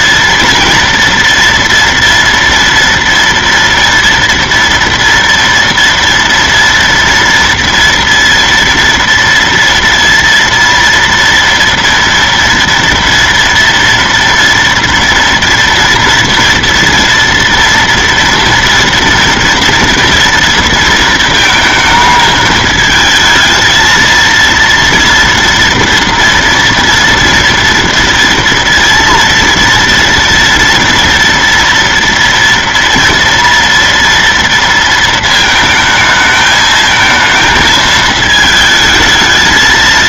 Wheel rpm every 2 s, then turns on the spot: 240, 230, 230, 230, 230, 230, 230, 230, 230, 240, 230, 210, 230, 240, 230, 230, 230, 230, 220, 220.
none